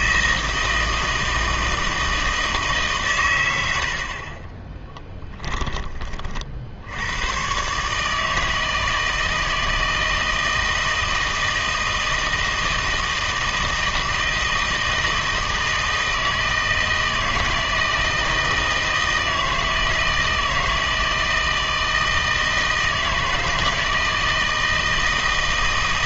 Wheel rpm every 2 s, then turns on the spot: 160, 150, 20, 60, 160, 160, 160, 160, 160, 160, 160, 160, 160.
4-6